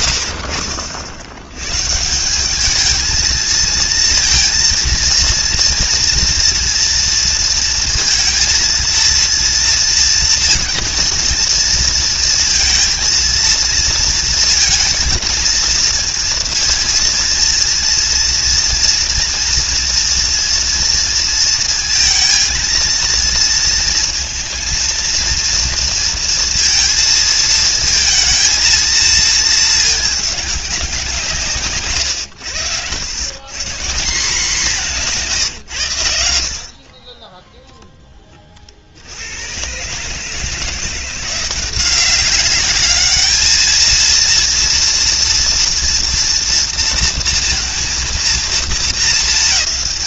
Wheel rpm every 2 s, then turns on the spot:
70, 210, 230, 230, 230, 230, 230, 230, 230, 230, 230, 230, 230, 230, 230, 190, 100, 190, 30, 80, 170, 210, 230, 230, 210.
none